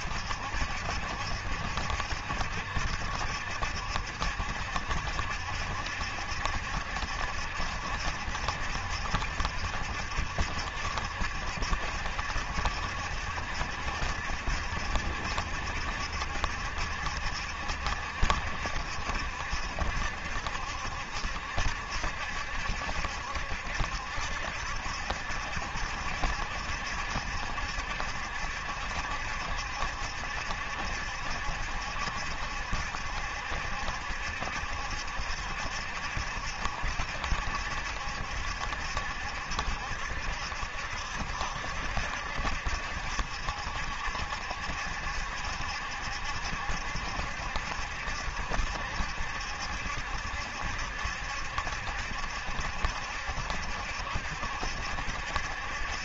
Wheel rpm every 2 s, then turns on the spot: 70, 70, 70, 70, 70, 70, 70, 70, 70, 70, 70, 70, 70, 70, 70, 70, 70, 70, 70, 70, 60, 70, 70, 70, 70, 70, 70, 60.
none